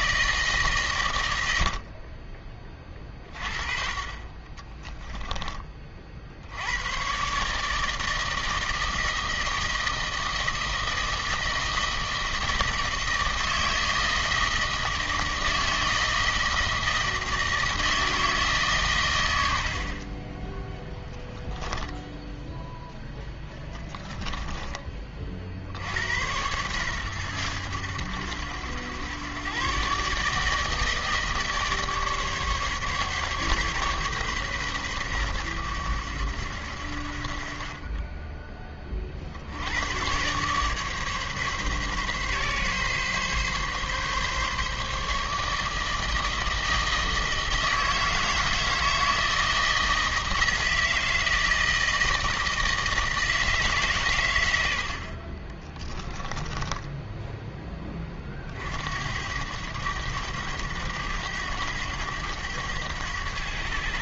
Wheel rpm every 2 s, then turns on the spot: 120, 20, 20, 110, 160, 160, 160, 160, 160, 130, 10, 0, 20, 120, 110, 160, 140, 120, 70, 40, 140, 140, 150, 160, 160, 160, 160, 70, 10, 70, 100, 100.
4-6 20-22 56-58